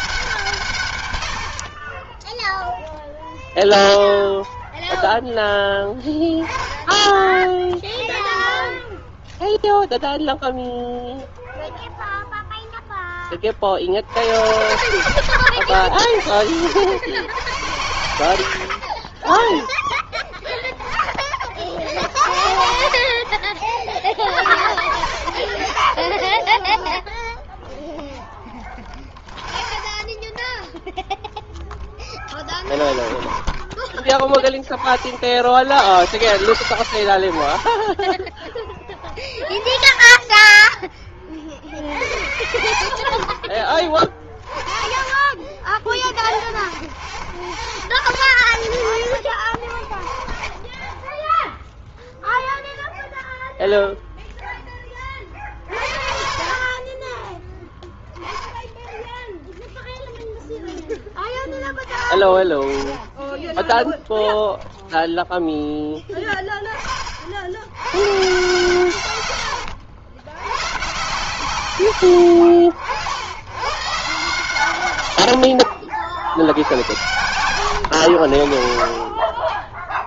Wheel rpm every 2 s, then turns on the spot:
120, 0, 0, 0, 0, 0, 10, 80, 100, 50, 10, 50, 20, 0, 0, 0, 10, 30, 90, 10, 10, 70, 30, 10, 20, 0, 0, 20, 30, 0, 0, 10, 0, 20, 130, 130, 80, 110, 90, 40.
44-46